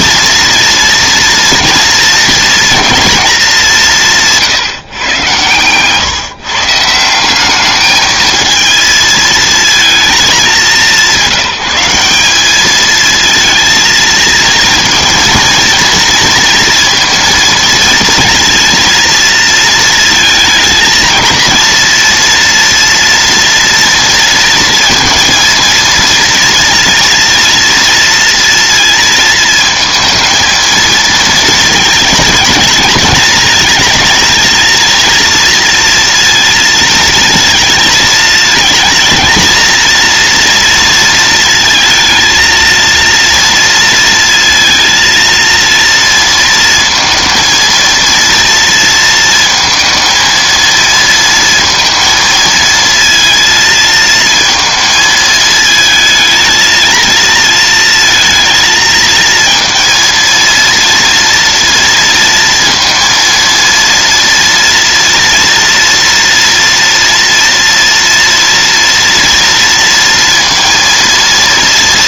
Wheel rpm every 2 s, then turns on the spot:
240, 230, 140, 160, 220, 200, 220, 230, 230, 230, 230, 230, 230, 230, 230, 230, 220, 230, 230, 230, 230, 230, 230, 220, 230, 230, 230, 220, 220, 230, 230, 230, 230, 230, 230, 230.
none